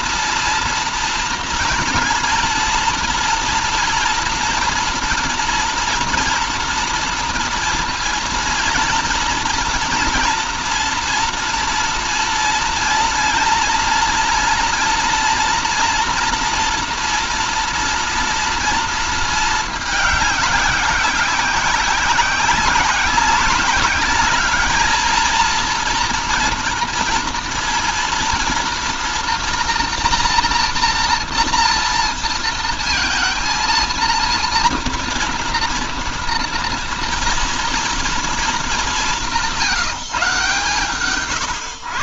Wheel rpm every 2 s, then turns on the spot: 230, 230, 240, 230, 230, 240, 240, 240, 230, 230, 190, 190, 220, 230, 230, 230, 230, 230, 230, 200, 130.
none